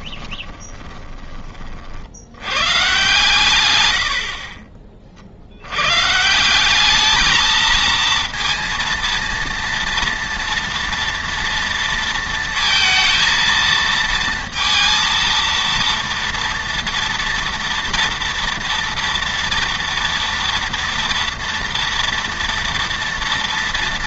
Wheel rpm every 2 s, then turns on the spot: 10, 120, 50, 200, 230, 230, 230, 230, 230, 230, 230, 230.
0-2